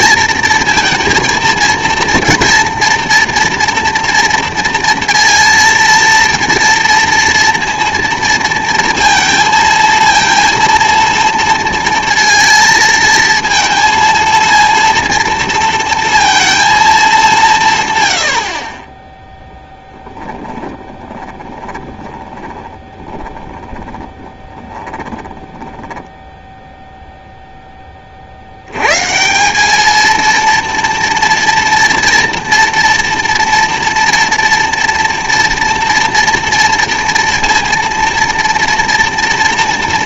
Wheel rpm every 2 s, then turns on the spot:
230, 240, 230, 230, 230, 230, 230, 230, 230, 40, 20, 20, 10, 0, 90, 230, 240, 230, 230, 230.
20-26